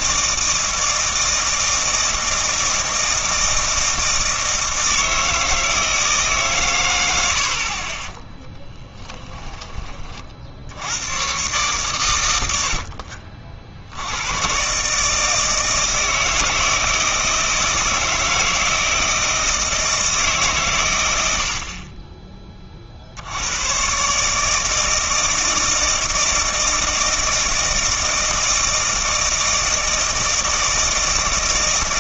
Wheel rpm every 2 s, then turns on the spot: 160, 160, 160, 120, 10, 80, 60, 130, 160, 160, 120, 40, 160, 160, 160, 160.
8-10